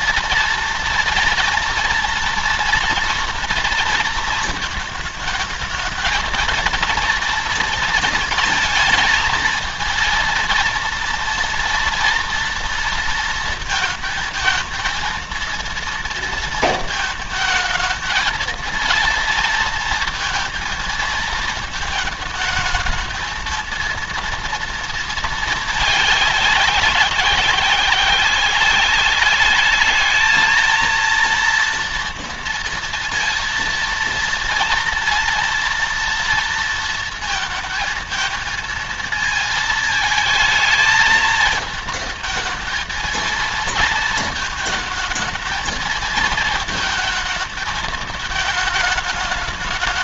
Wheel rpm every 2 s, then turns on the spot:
230, 240, 230, 230, 230, 230, 230, 220, 230, 220, 230, 220, 230, 190, 190, 220, 230, 230, 230, 230, 220, 220, 230, 220, 220.
none